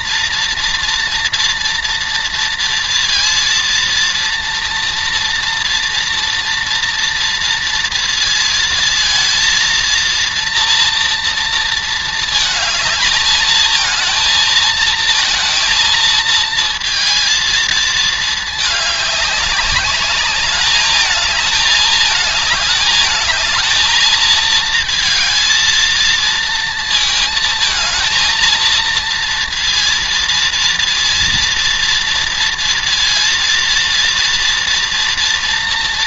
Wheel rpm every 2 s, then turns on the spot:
230, 230, 230, 230, 230, 230, 220, 230, 230, 210, 210, 210, 220, 230, 230, 230, 230, 230.
none